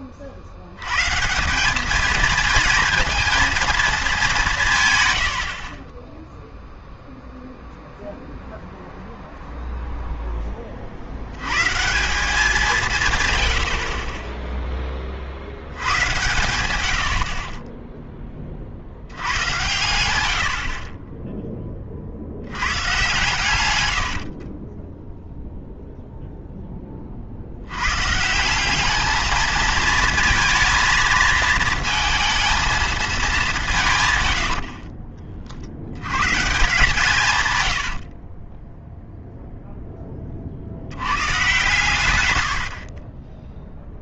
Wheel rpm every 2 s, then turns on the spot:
90, 230, 150, 0, 0, 30, 180, 20, 100, 40, 50, 100, 20, 20, 190, 230, 230, 50, 140, 10, 70, 60.
24-26 34-36 42-44